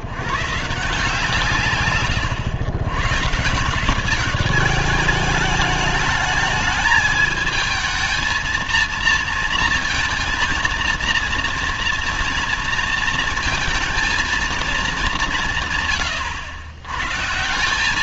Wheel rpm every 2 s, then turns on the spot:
120, 110, 200, 210, 220, 230, 230, 220, 110.
none